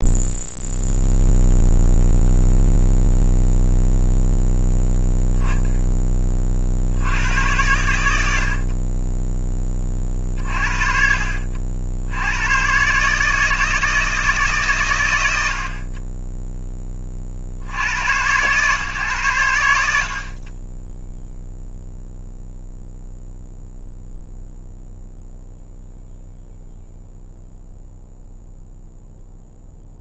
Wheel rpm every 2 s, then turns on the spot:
0, 0, 0, 70, 30, 40, 130, 130, 10, 130, 10, 0, 0, 0, 0.
none